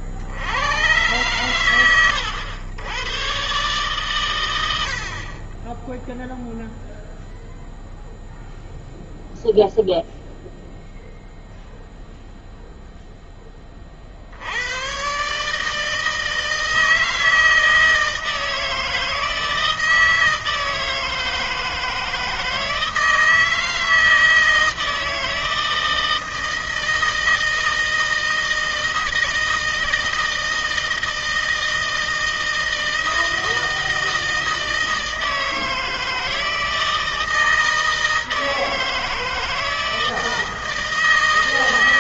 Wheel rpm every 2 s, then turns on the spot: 80, 100, 100, 0, 0, 0, 0, 80, 160, 160, 160, 160, 160, 160, 170, 160, 160, 160, 160, 160, 160.
none